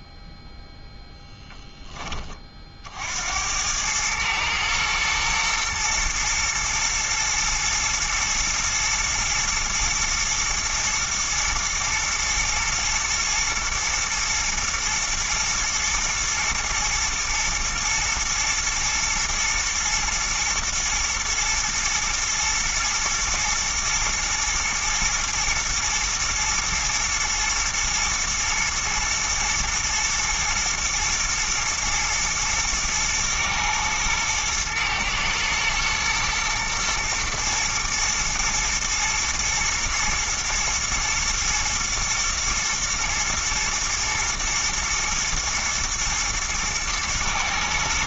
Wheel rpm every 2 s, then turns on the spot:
0, 50, 110, 110, 110, 110, 120, 110, 110, 110, 110, 110, 110, 110, 110, 120, 120, 110, 110, 110, 110, 110, 110, 110.
none